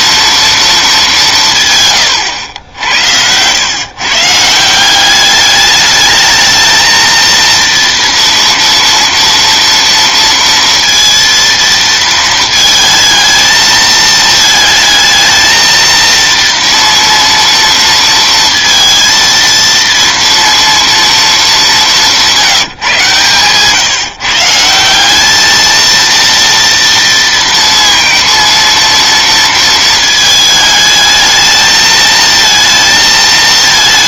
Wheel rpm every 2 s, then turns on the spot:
220, 80, 170, 220, 230, 230, 220, 220, 230, 230, 230, 160, 170, 230, 230, 220, 220.
none